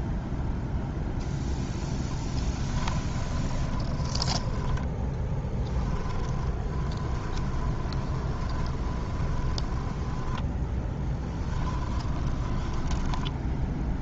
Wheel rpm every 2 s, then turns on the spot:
0, 10, 10, 20, 20, 10, 10.
2-14